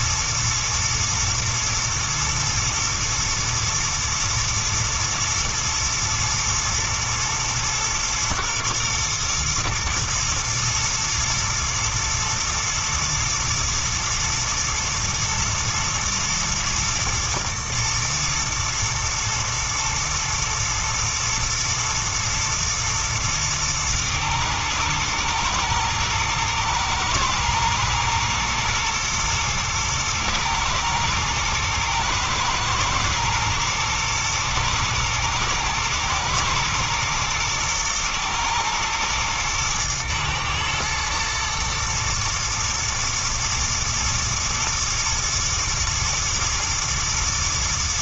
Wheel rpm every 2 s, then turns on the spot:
120, 120, 110, 120, 120, 120, 110, 110, 110, 110, 110, 110, 110, 110, 110, 110, 110, 120, 120, 110, 110, 120, 110, 110.
none